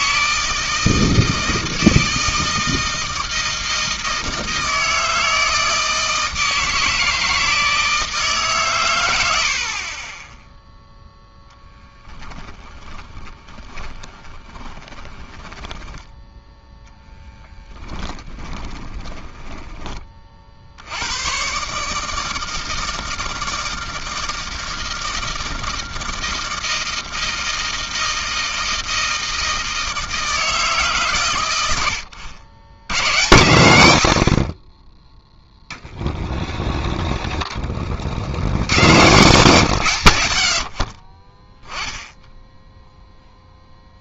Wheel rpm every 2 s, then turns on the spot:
160, 160, 160, 160, 130, 0, 20, 30, 0, 20, 50, 160, 160, 160, 160, 150, 90, 40, 20, 90, 70, 10.
12-16 18-20